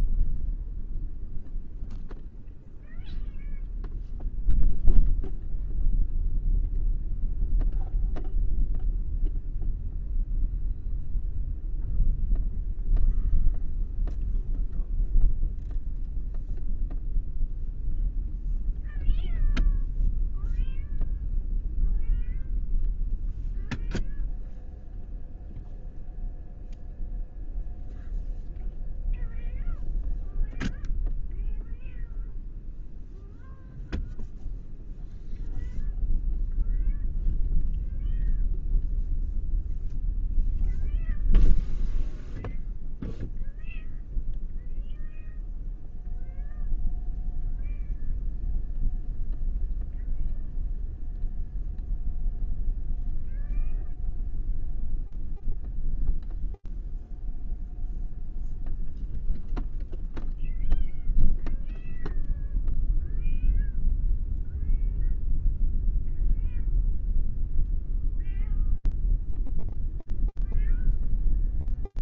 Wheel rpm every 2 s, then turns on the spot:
0, 0, 0, 0, 0, 0, 0, 0, 0, 0, 0, 0, 0, 0, 0, 0, 0, 0, 0, 0, 0, 0, 0, 0, 0, 0, 0, 0, 0, 0, 0, 0, 0, 0, 0, 0.
none